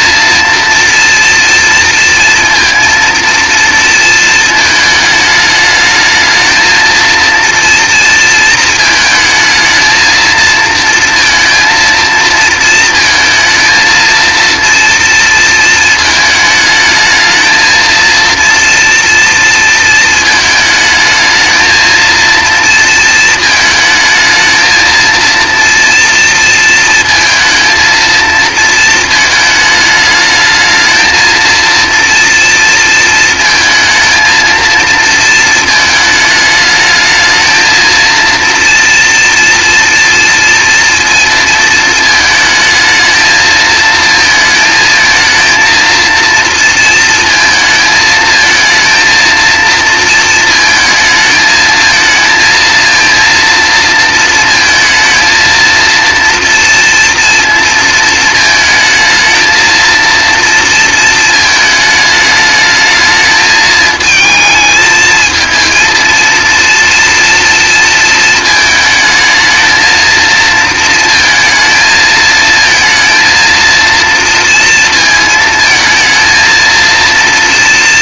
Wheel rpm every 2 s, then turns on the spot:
230, 230, 220, 230, 220, 230, 230, 230, 220, 230, 220, 230, 230, 230, 220, 220, 230, 230, 220, 230, 230, 220, 220, 230, 230, 220, 230, 230, 230, 220, 230, 220, 220, 230, 220, 230, 230, 230, 230.
none